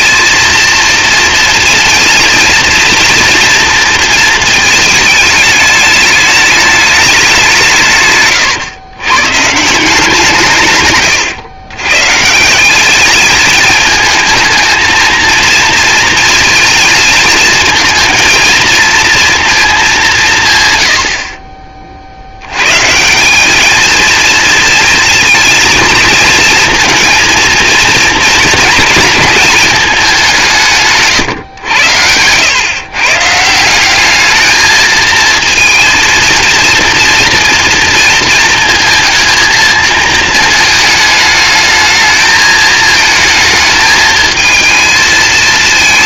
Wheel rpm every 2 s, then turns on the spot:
230, 230, 220, 210, 120, 120, 190, 230, 220, 230, 120, 130, 230, 230, 220, 150, 130, 220, 230, 230, 220, 220, 220.
none